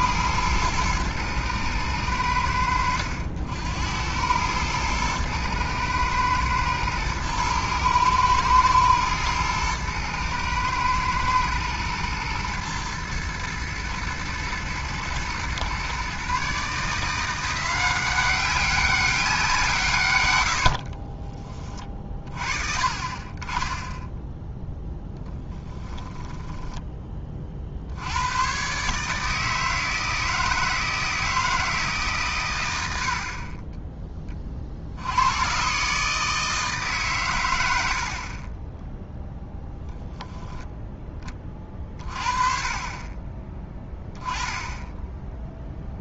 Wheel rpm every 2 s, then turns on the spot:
110, 70, 110, 110, 110, 110, 120, 110, 150, 190, 80, 50, 0, 10, 120, 160, 100, 50, 150, 10, 10, 30, 10.
20-22